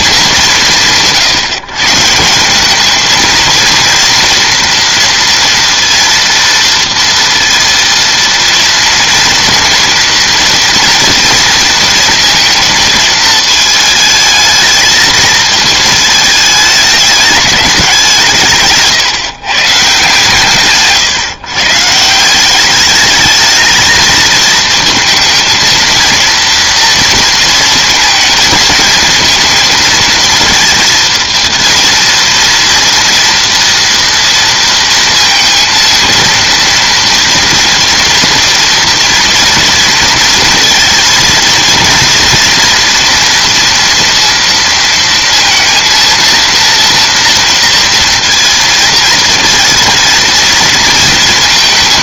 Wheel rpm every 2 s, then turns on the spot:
140, 200, 230, 230, 230, 230, 220, 220, 210, 150, 150, 190, 220, 230, 220, 230, 230, 230, 230, 230, 220, 230, 230, 230, 230, 230.
18-20